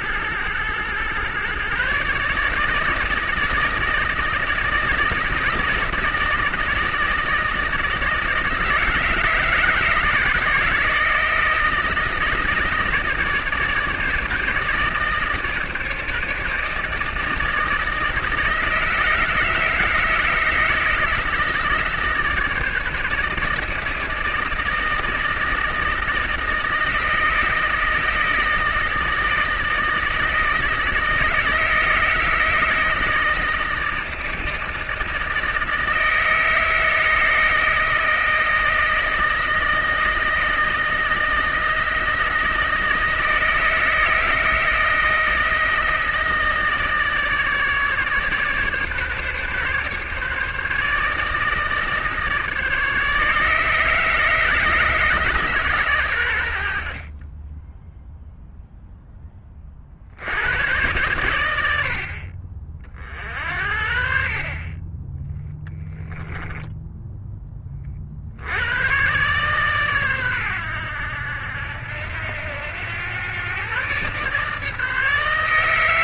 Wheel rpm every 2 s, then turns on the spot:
120, 150, 150, 160, 160, 150, 150, 160, 160, 160, 160, 160, 160, 160, 160, 160, 160, 160, 160, 160, 160, 160, 160, 160, 140, 150, 150, 150, 70, 0, 110, 50, 30, 10, 110, 100, 100, 150.
none